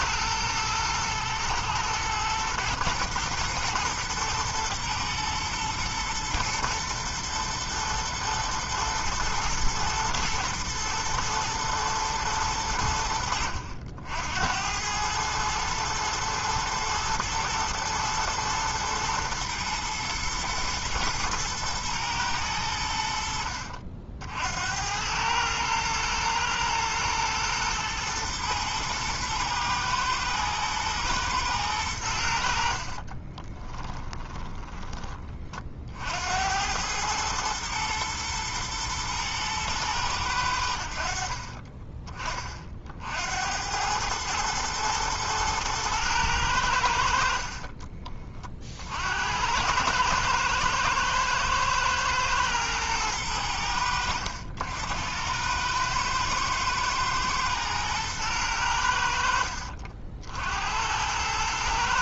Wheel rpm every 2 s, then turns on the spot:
110, 110, 110, 110, 110, 110, 70, 110, 110, 110, 110, 90, 100, 110, 120, 110, 30, 20, 110, 110, 90, 40, 110, 70, 50, 110, 110, 90, 110, 70, 100.
32-34